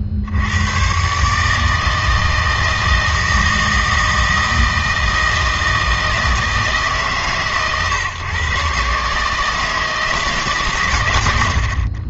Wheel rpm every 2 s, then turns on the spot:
110, 160, 160, 160, 140, 140.
none